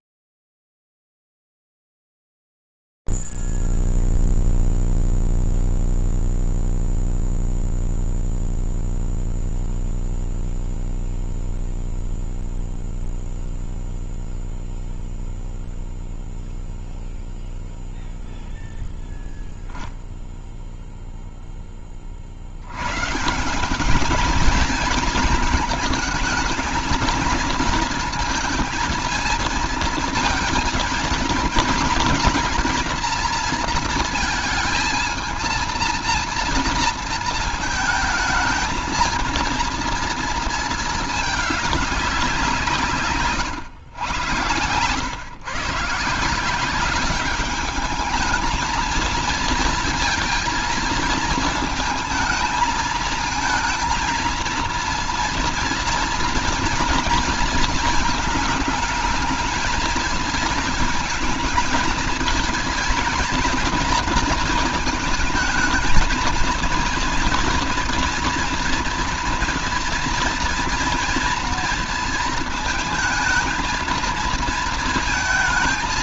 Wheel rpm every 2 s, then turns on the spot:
0, 0, 0, 0, 0, 0, 0, 0, 0, 0, 0, 50, 220, 220, 230, 230, 230, 230, 230, 220, 230, 170, 120, 180, 220, 230, 220, 230, 240, 220, 220, 220, 230, 230, 230, 230, 230, 230.
none